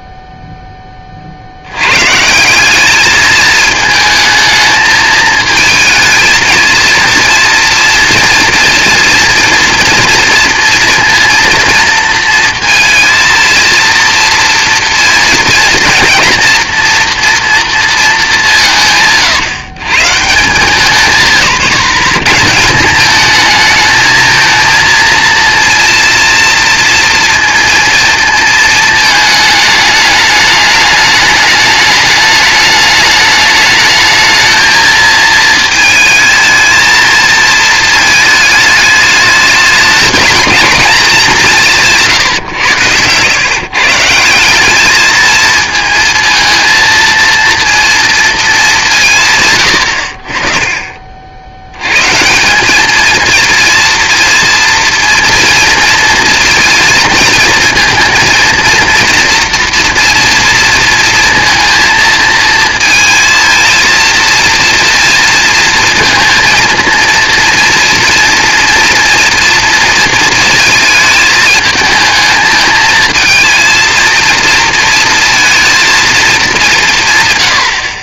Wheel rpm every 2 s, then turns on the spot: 40, 210, 220, 230, 240, 230, 230, 230, 230, 140, 150, 210, 230, 230, 220, 210, 210, 230, 230, 210, 210, 110, 220, 230, 160, 40, 210, 230, 230, 230, 230, 220, 230, 230, 240, 220, 230, 230, 220.
none